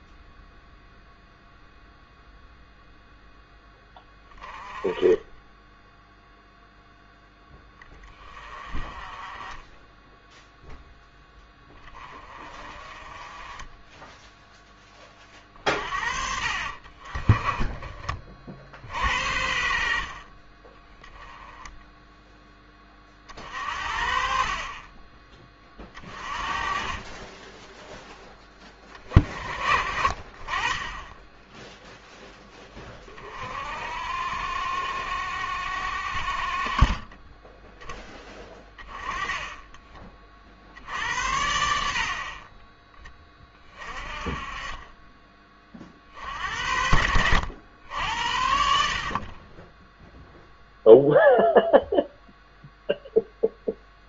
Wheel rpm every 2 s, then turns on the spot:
0, 0, 10, 0, 20, 0, 20, 10, 40, 50, 20, 20, 30, 30, 20, 20, 20, 60, 40, 20, 60, 30, 20, 70, 60, 0, 0.
38-40